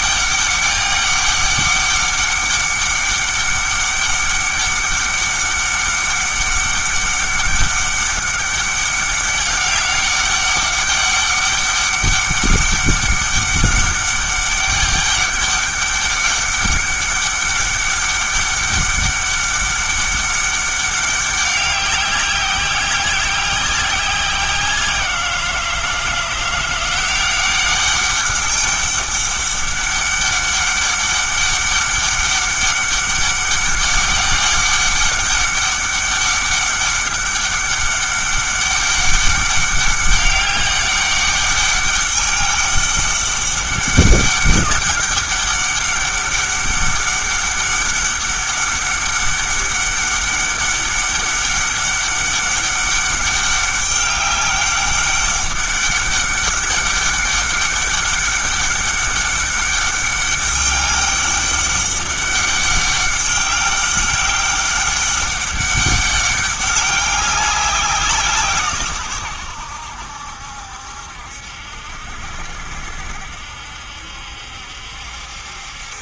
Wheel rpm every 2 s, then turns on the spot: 200, 200, 200, 200, 200, 200, 200, 200, 200, 200, 200, 190, 180, 170, 200, 200, 200, 200, 200, 200, 200, 200, 200, 200, 200, 200, 200, 200, 200, 200, 200, 200, 200, 200, 140, 70, 70, 70.
none